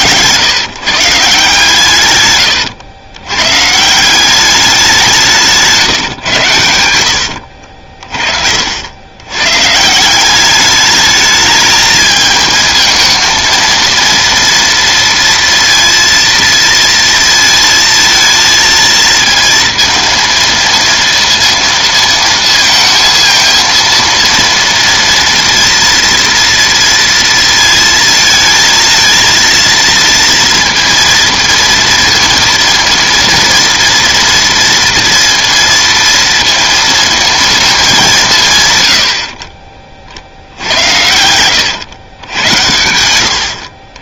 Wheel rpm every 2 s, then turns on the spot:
150, 110, 190, 110, 60, 200, 220, 230, 230, 230, 230, 230, 230, 240, 230, 230, 230, 230, 230, 150, 80, 100.
40-42